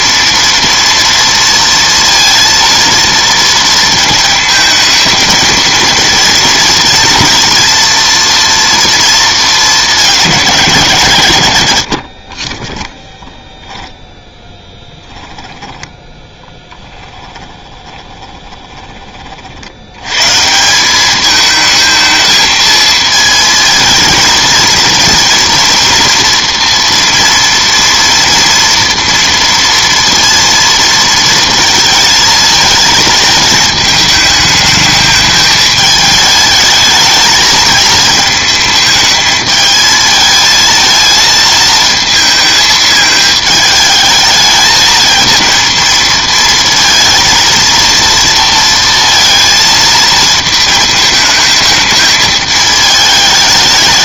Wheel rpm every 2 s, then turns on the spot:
230, 230, 220, 230, 230, 170, 20, 10, 10, 20, 180, 220, 230, 240, 230, 230, 220, 210, 220, 220, 220, 220, 220, 230, 230, 220, 220.
12-14 16-20